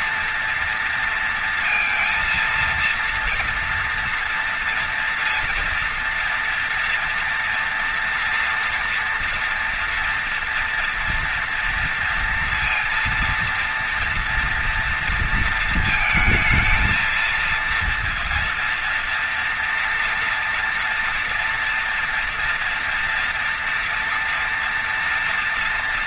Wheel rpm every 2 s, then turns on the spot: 230, 230, 230, 240, 240, 240, 230, 230, 230, 230, 230, 230, 230.
none